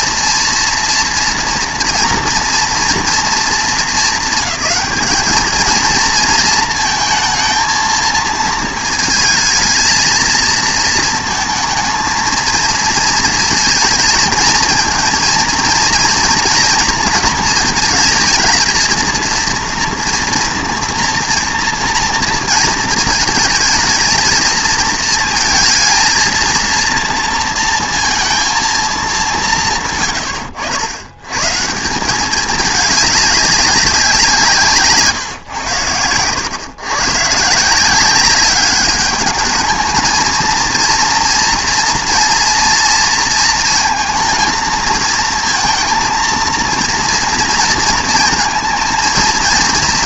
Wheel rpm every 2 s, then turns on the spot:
230, 230, 200, 220, 220, 230, 230, 230, 230, 230, 230, 230, 230, 230, 220, 90, 210, 160, 120, 200, 230, 230, 220, 230, 230.
none